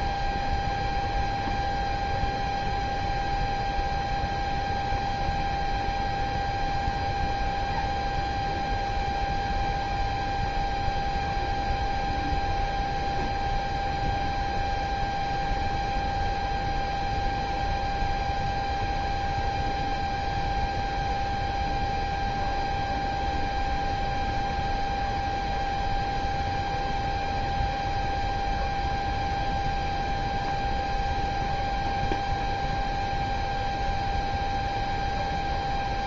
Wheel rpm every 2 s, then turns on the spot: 0, 0, 0, 0, 0, 0, 0, 0, 0, 0, 0, 0, 0, 0, 0, 0, 0, 0.
none